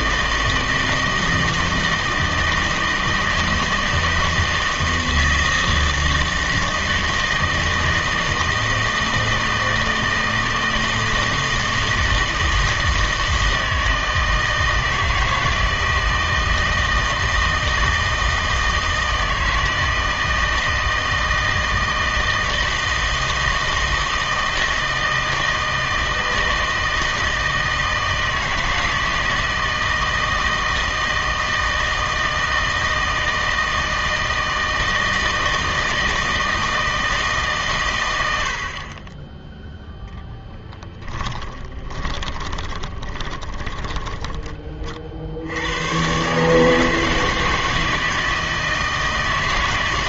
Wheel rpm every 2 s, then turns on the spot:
160, 160, 160, 160, 160, 160, 160, 160, 160, 160, 160, 160, 160, 160, 160, 160, 160, 160, 160, 60, 20, 20, 20, 150, 160.
40-44